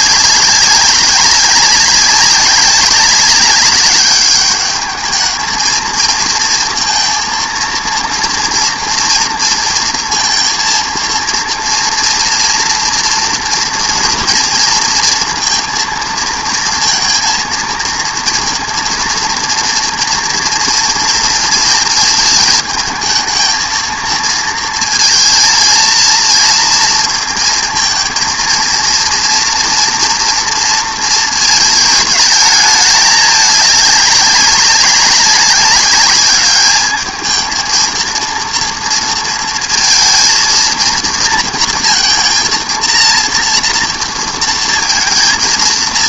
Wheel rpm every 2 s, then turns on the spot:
190, 190, 210, 220, 230, 230, 230, 230, 230, 230, 230, 220, 230, 230, 230, 230, 210, 190, 210, 230, 230, 230, 220.
none